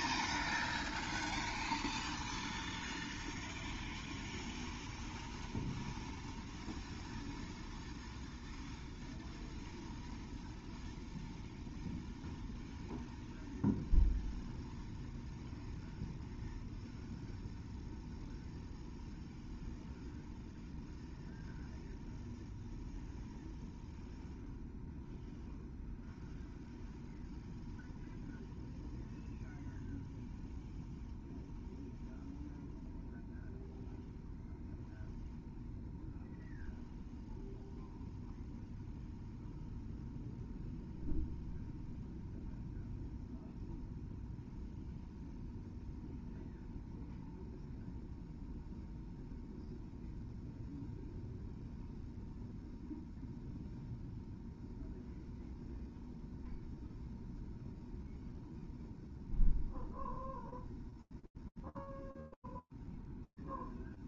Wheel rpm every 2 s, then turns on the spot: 0, 0, 0, 0, 0, 0, 0, 0, 0, 0, 0, 0, 0, 0, 0, 0, 0, 0, 0, 0, 0, 0, 0, 0, 0, 0, 0, 0, 0, 0, 0, 0.
none